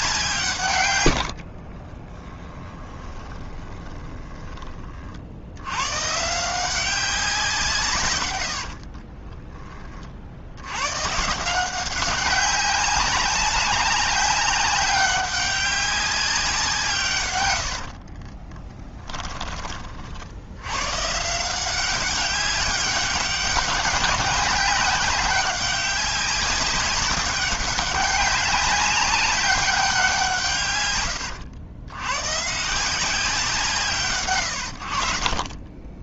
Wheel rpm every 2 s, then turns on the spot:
110, 10, 30, 180, 50, 110, 190, 200, 160, 20, 110, 190, 190, 190, 200, 140, 160, 60.
2-4 8-10 18-20